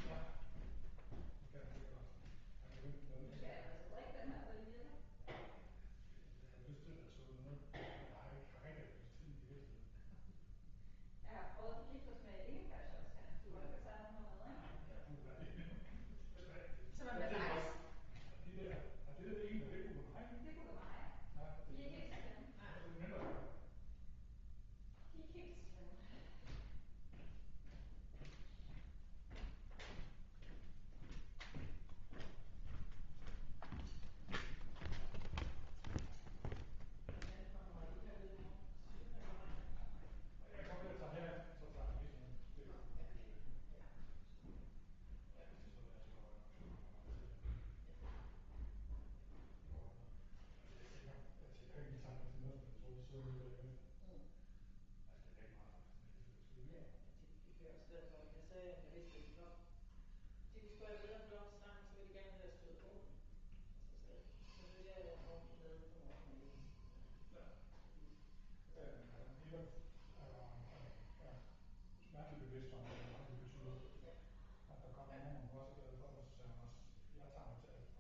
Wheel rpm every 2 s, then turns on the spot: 0, 0, 0, 0, 0, 0, 0, 0, 0, 0, 0, 0, 0, 0, 0, 0, 0, 0, 0, 0, 0, 0, 0, 0, 0, 0, 0, 0, 0, 0, 0, 0, 0, 0, 0, 0, 0, 0, 0.
none